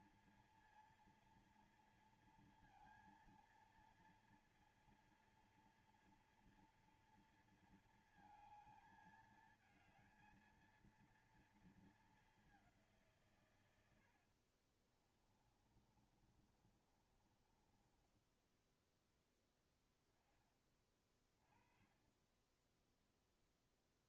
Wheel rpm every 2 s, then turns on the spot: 240, 230, 230, 230, 220, 230, 170, 40, 30, 10, 20, 10.
14-18 22-24